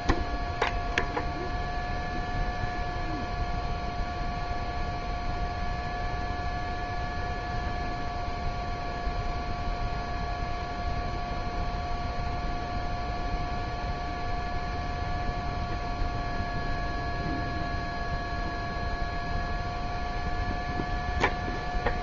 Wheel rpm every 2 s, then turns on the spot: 0, 0, 0, 0, 0, 0, 0, 0, 0, 0, 0.
none